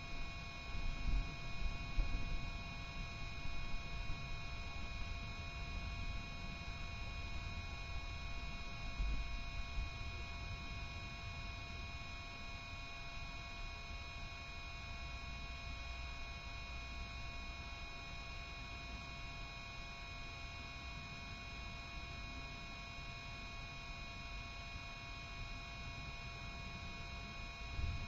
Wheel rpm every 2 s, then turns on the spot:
0, 0, 0, 0, 0, 0, 0, 0, 0, 0, 0, 0, 0, 0.
none